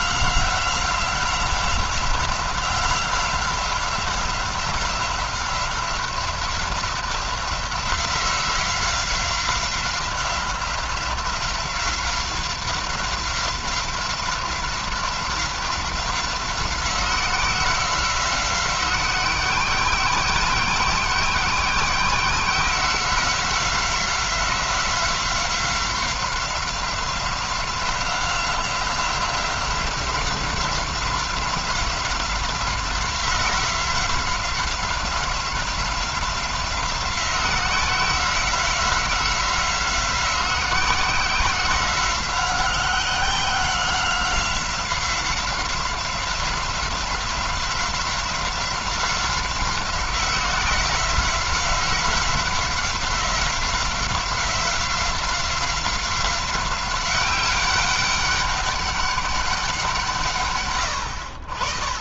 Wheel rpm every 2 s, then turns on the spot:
180, 180, 180, 190, 180, 180, 180, 180, 180, 190, 180, 190, 180, 180, 180, 180, 180, 180, 180, 180, 180, 180, 190, 190, 180, 180, 180, 180, 190, 200, 80.
none